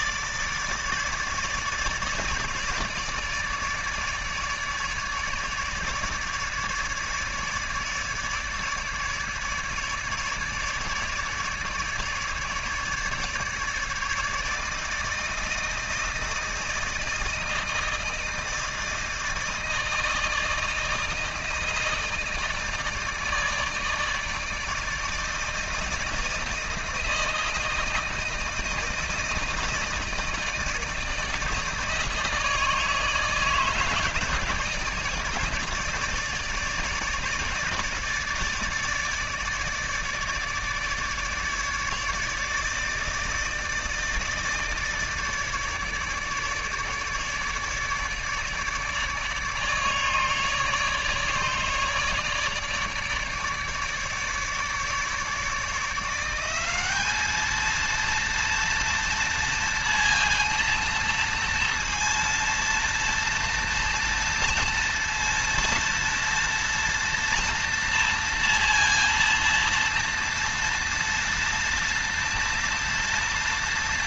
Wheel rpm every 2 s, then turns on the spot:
150, 150, 150, 150, 150, 150, 150, 160, 160, 160, 160, 160, 160, 160, 160, 160, 150, 150, 150, 150, 150, 150, 160, 150, 150, 150, 150, 150, 190, 230, 230, 230, 230, 230, 230, 230, 230.
none